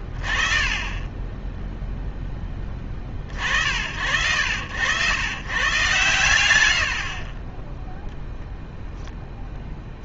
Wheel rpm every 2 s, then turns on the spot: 40, 10, 80, 60, 0.
none